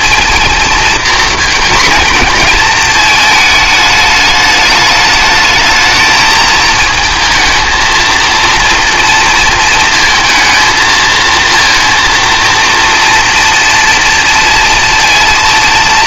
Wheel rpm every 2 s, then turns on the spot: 230, 220, 210, 220, 230, 220, 230, 230.
none